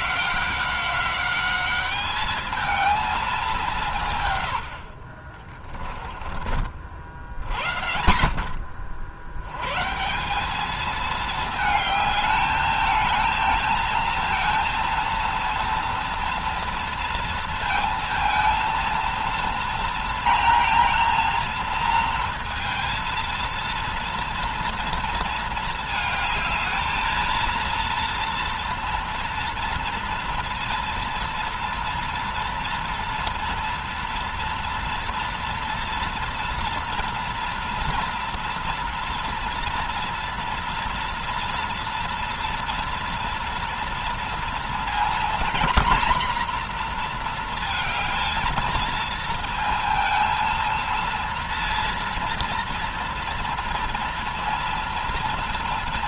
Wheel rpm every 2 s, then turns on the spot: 200, 220, 110, 40, 50, 200, 220, 230, 230, 230, 240, 230, 230, 220, 230, 230, 230, 230, 230, 230, 230, 230, 230, 240, 220, 230, 230, 230.
none